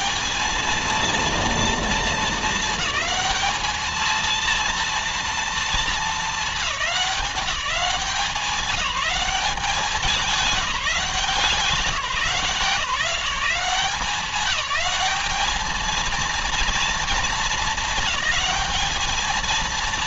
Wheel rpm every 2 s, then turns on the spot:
210, 210, 230, 220, 190, 180, 180, 190, 230, 210.
none